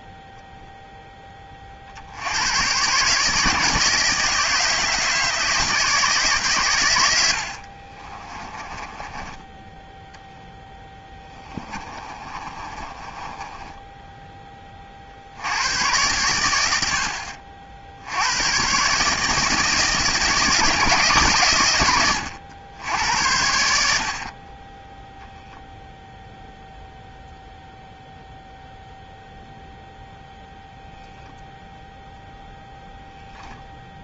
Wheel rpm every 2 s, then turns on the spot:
0, 100, 160, 130, 20, 0, 30, 20, 90, 100, 150, 90, 20, 0, 0, 0, 0.
8-10 12-14